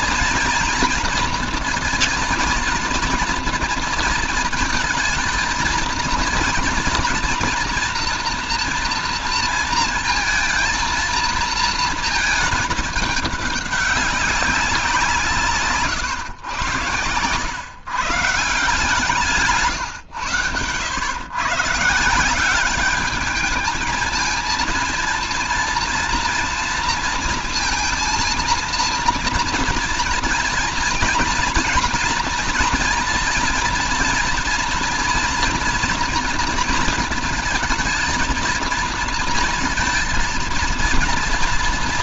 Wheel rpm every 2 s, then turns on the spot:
230, 230, 230, 230, 230, 230, 220, 180, 110, 160, 110, 200, 230, 230, 230, 230, 230, 240, 230, 220, 230.
none